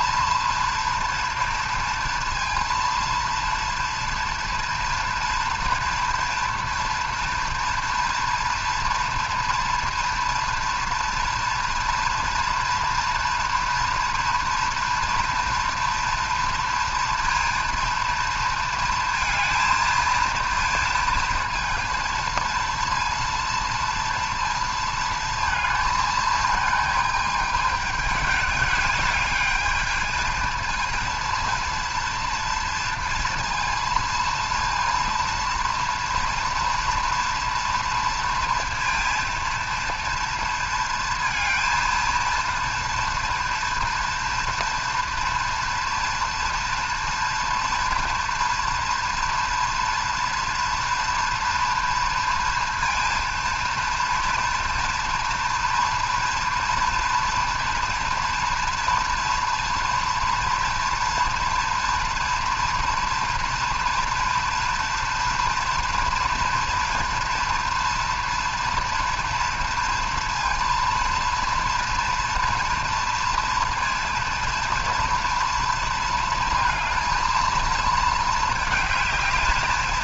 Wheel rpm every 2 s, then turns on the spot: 240, 230, 240, 230, 230, 230, 230, 230, 230, 230, 230, 230, 230, 220, 210, 230, 230, 230, 240, 230, 230, 230, 230, 240, 230, 230, 230, 230, 230, 230, 230, 230, 230, 230, 230, 230, 230, 230, 230, 220.
none